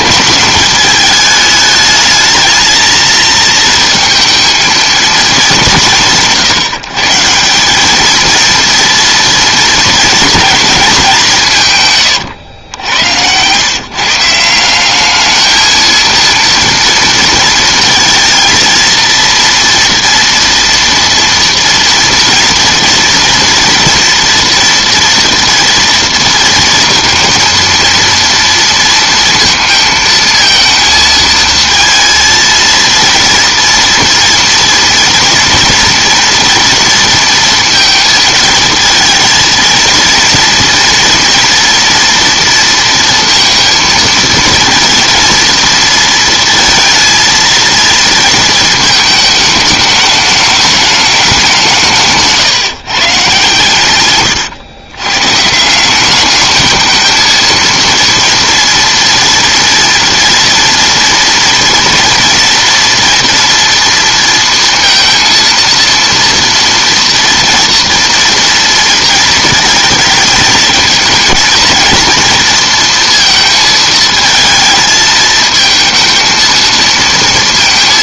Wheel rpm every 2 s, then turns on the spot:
210, 220, 220, 140, 230, 220, 100, 170, 230, 230, 230, 230, 240, 230, 230, 230, 230, 230, 230, 230, 230, 230, 230, 230, 220, 210, 160, 100, 210, 230, 230, 230, 230, 230, 230, 230, 230, 220, 230.
none